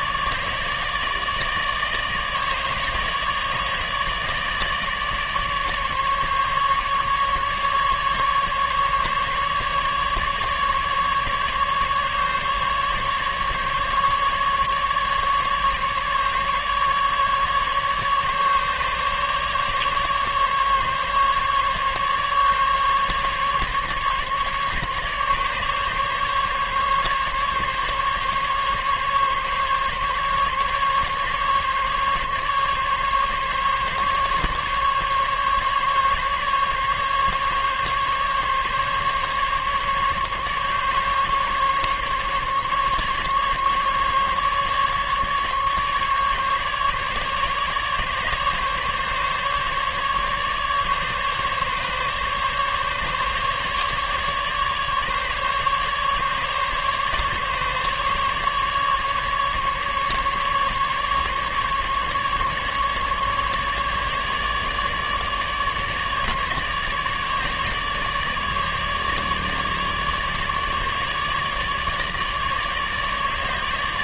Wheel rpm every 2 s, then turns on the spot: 150, 150, 150, 140, 150, 150, 140, 140, 140, 150, 140, 140, 140, 140, 140, 140, 140, 140, 140, 140, 140, 140, 140, 140, 150, 150, 140, 150, 150, 150, 150, 140, 150, 150, 150, 150, 150.
none